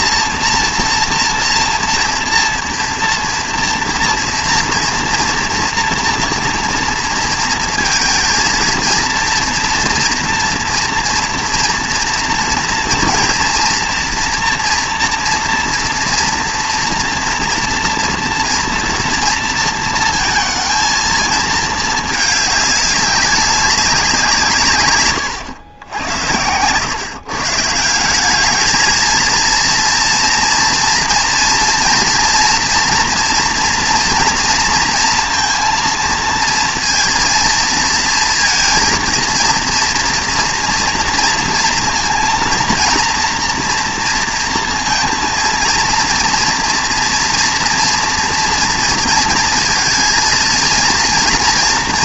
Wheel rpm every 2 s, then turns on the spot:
230, 230, 230, 230, 230, 240, 230, 230, 230, 230, 220, 210, 140, 110, 220, 230, 240, 230, 230, 230, 230, 230, 230, 240, 230, 230.
26-28